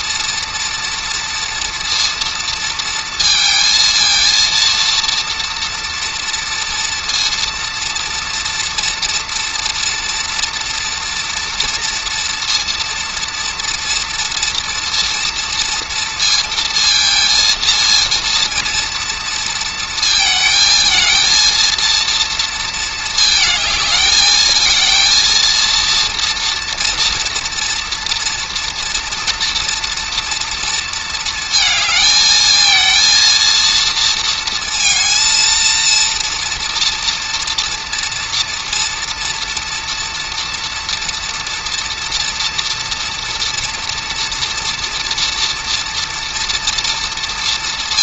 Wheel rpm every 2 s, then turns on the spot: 230, 230, 230, 230, 230, 230, 230, 230, 230, 230, 220, 220, 230, 230, 230, 230, 220, 230, 230, 230, 230, 230, 230, 230.
none